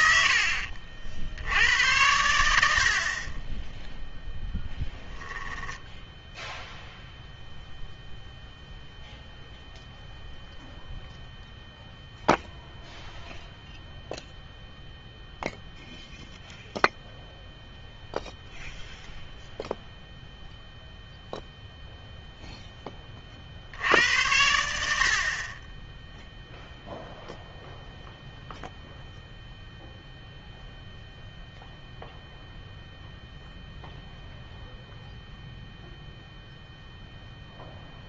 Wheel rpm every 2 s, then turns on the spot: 50, 80, 0, 0, 0, 0, 0, 0, 0, 0, 0, 10, 70, 0, 0, 0, 0, 0, 0.
none